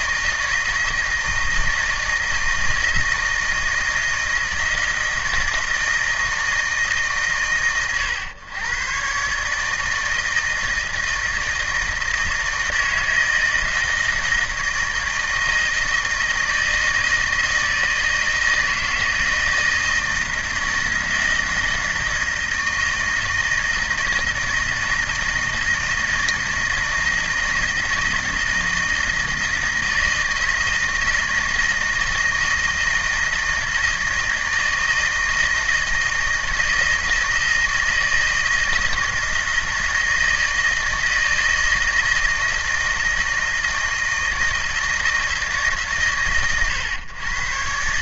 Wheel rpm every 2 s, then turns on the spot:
160, 160, 160, 150, 110, 160, 160, 160, 160, 160, 160, 160, 160, 160, 160, 160, 160, 160, 160, 160, 160, 160, 160, 110.
none